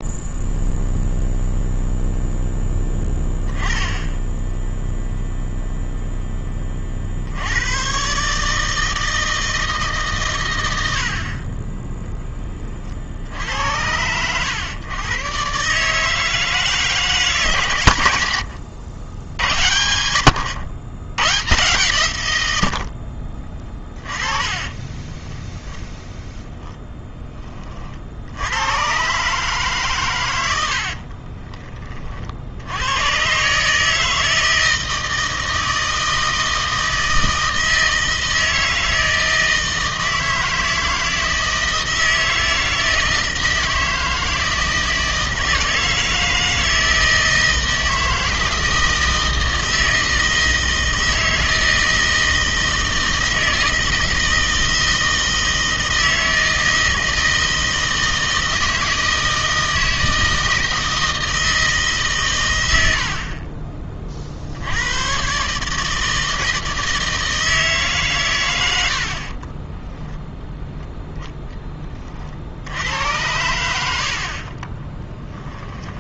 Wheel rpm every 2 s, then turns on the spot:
0, 10, 0, 30, 160, 70, 50, 120, 160, 90, 100, 60, 10, 10, 110, 60, 100, 160, 160, 160, 160, 160, 160, 160, 160, 160, 160, 160, 160, 160, 160, 80, 100, 160, 80, 0, 80, 20.
24-26 30-32 74-76